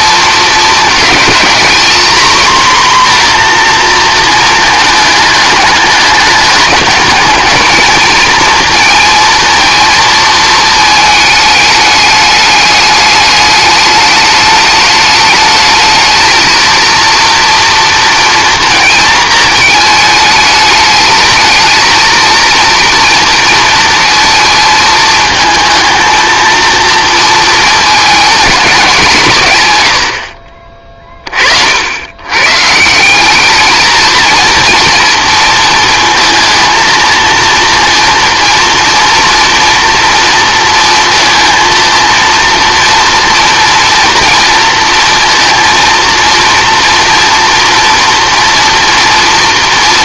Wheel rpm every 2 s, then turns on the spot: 220, 250, 220, 210, 230, 220, 210, 210, 230, 230, 210, 230, 220, 230, 220, 40, 140, 230, 230, 230, 230, 230, 230, 240, 230.
none